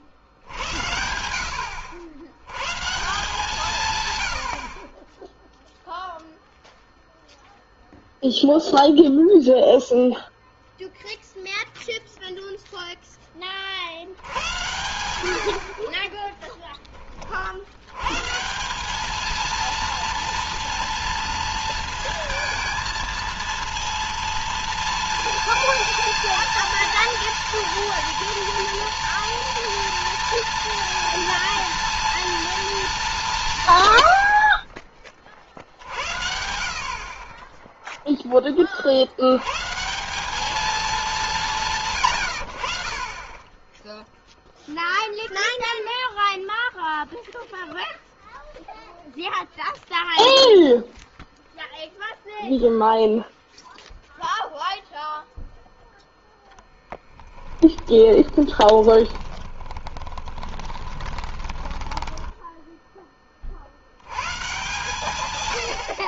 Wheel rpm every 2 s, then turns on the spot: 90, 120, 80, 0, 0, 0, 0, 90, 20, 170, 230, 230, 230, 230, 230, 230, 230, 70, 70, 20, 210, 90, 0, 0, 0, 0, 0, 0, 10, 20, 20, 10, 130.
16-18 56-62